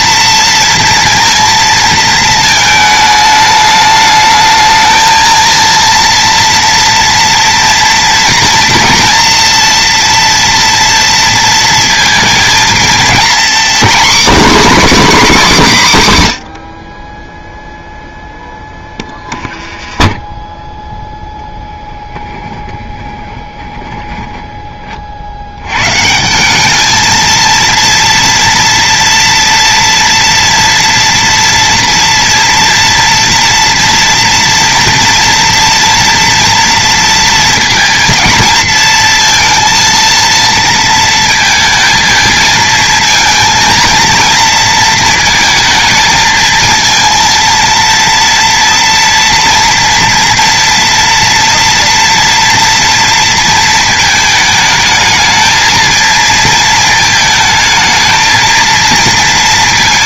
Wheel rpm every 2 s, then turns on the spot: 230, 220, 220, 230, 240, 230, 220, 270, 50, 10, 10, 20, 40, 210, 230, 230, 230, 230, 230, 230, 230, 230, 220, 230, 230, 230, 230, 220, 220, 230.
22-24